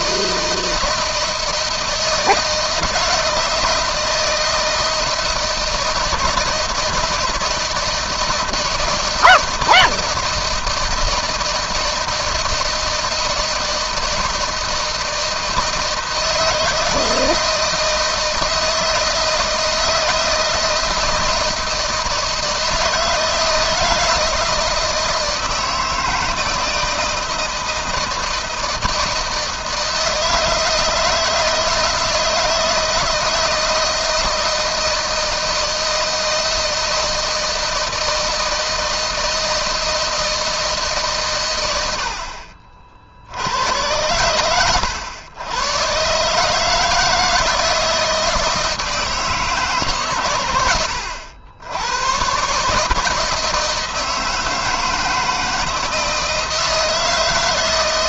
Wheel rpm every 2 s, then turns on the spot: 160, 160, 160, 160, 160, 160, 160, 160, 160, 160, 160, 160, 160, 160, 160, 160, 160, 160, 160, 160, 160, 50, 100, 150, 160, 110, 130, 160, 160.
none